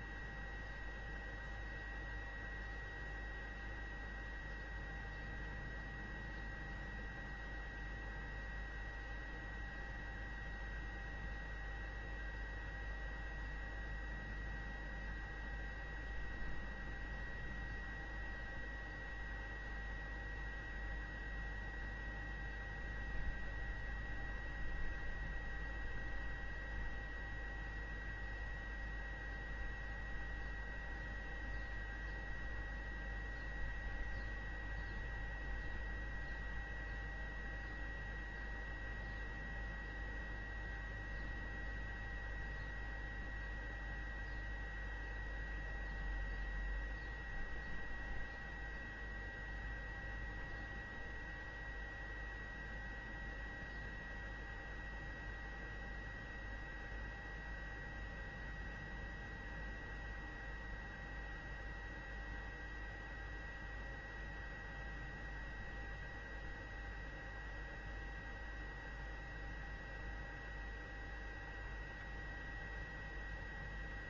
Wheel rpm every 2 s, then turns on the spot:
0, 0, 0, 0, 0, 0, 0, 0, 0, 0, 0, 0, 0, 0, 0, 0, 0, 0, 0, 0, 0, 0, 0, 0, 0, 0, 0, 0, 0, 0, 0, 0, 0, 0, 0, 0, 0.
none